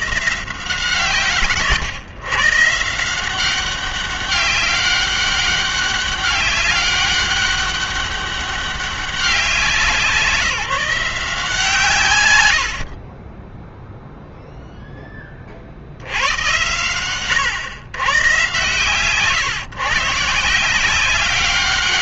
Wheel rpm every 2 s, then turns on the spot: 160, 150, 200, 200, 200, 180, 70, 0, 100, 140, 170.
none